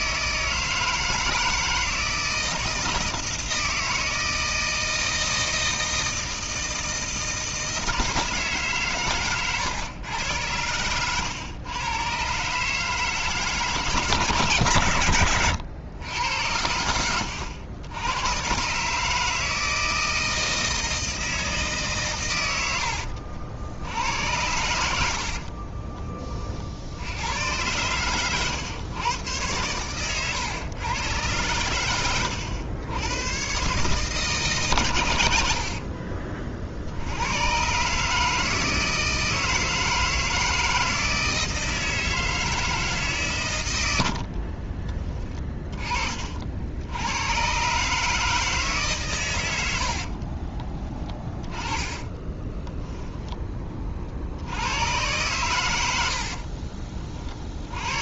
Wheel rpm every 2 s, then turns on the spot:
160, 160, 160, 160, 140, 100, 150, 130, 90, 130, 160, 90, 90, 60, 110, 120, 110, 120, 60, 160, 160, 160, 30, 80, 140, 30, 20, 100, 30.
10-12 44-46 50-54 56-58